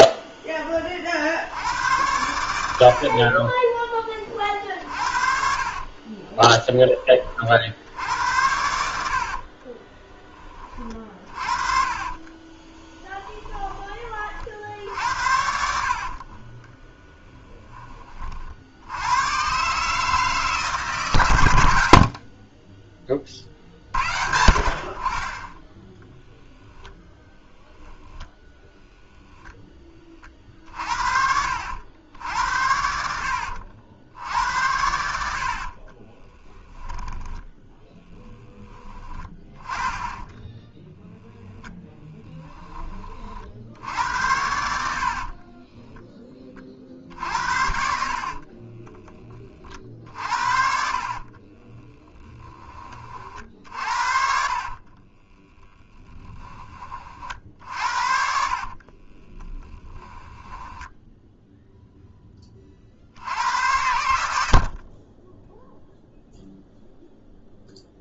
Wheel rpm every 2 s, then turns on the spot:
30, 60, 60, 20, 70, 40, 10, 60, 10, 90, 140, 20, 50, 0, 0, 50, 70, 80, 10, 20, 10, 20, 60, 50, 20, 50, 30, 40, 40, 30, 10, 50, 40, 0.
10-14 16-18 38-40 44-46 50-52 54-56 58-62